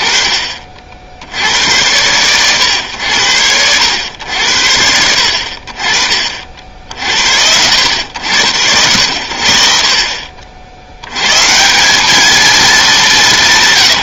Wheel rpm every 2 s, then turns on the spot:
60, 80, 50, 80, 90, 110, 190.
none